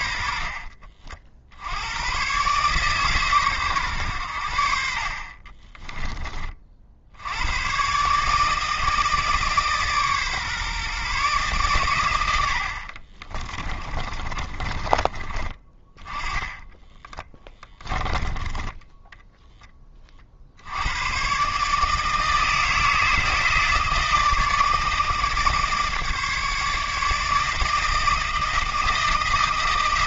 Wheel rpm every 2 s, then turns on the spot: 50, 140, 60, 60, 160, 140, 50, 30, 10, 10, 90, 160, 160, 150, 160.
12-18